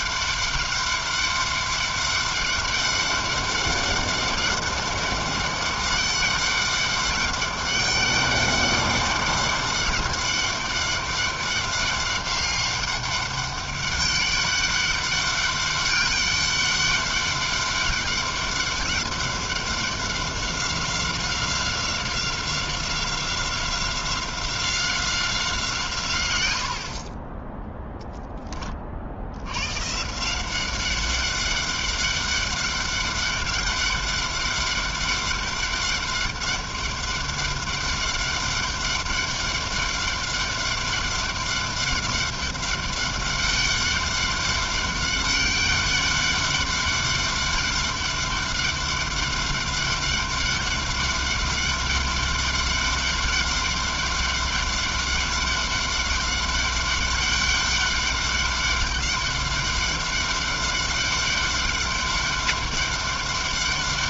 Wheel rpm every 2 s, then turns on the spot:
200, 200, 200, 200, 200, 200, 200, 200, 200, 200, 190, 190, 180, 20, 90, 200, 200, 200, 200, 200, 200, 200, 200, 200, 200, 200, 200, 200, 200, 200, 200, 200.
none